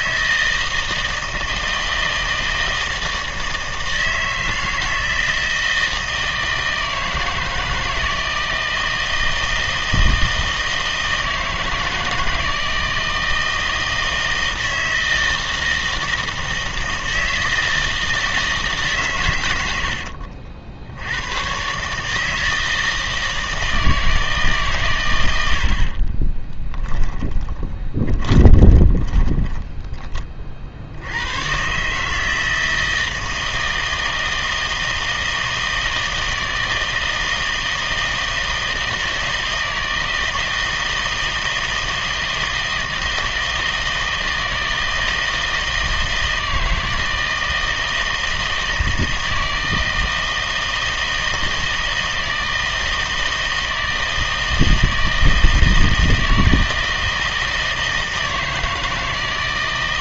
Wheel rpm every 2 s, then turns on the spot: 160, 160, 160, 160, 160, 160, 160, 160, 160, 150, 60, 160, 140, 20, 30, 60, 160, 160, 160, 160, 160, 160, 160, 160, 160, 160, 160, 160, 160, 160.
26-30